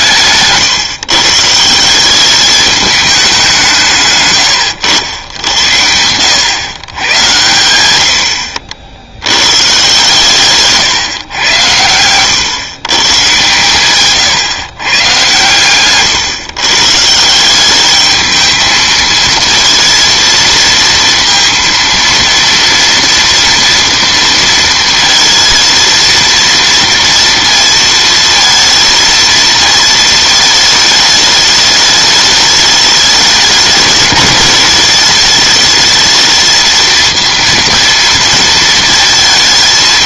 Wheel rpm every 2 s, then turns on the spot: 140, 210, 100, 120, 80, 140, 130, 130, 140, 220, 230, 230, 230, 230, 220, 210, 210, 210, 230, 230.
none